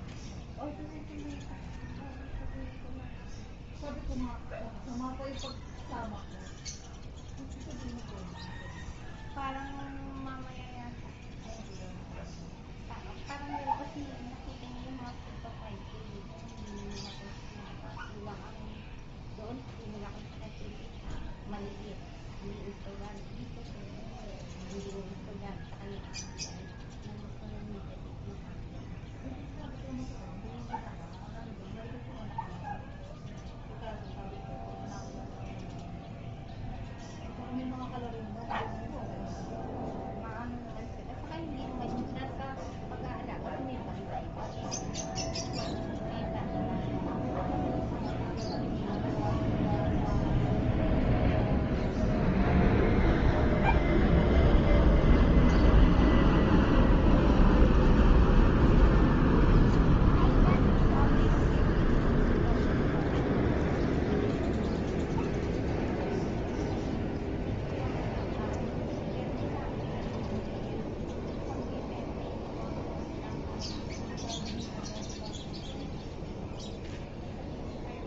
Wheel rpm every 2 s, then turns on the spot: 0, 0, 0, 0, 0, 0, 0, 0, 0, 0, 0, 0, 0, 0, 0, 0, 0, 0, 0, 0, 0, 0, 0, 0, 0, 0, 0, 0, 0, 0, 0, 0, 0, 0, 0, 0, 0, 0, 0.
none